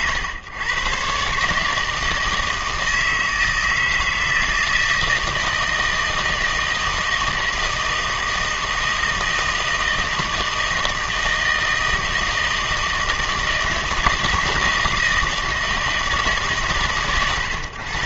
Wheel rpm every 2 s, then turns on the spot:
120, 160, 160, 160, 160, 160, 160, 160, 140.
none